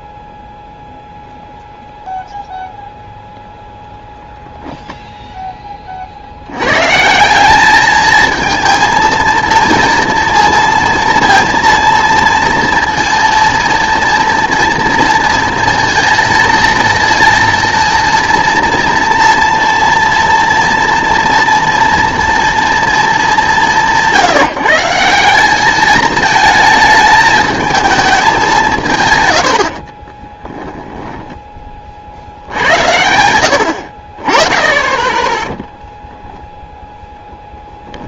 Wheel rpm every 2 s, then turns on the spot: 0, 0, 0, 90, 220, 230, 230, 230, 230, 230, 230, 230, 160, 220, 180, 10, 80, 20, 0.
30-32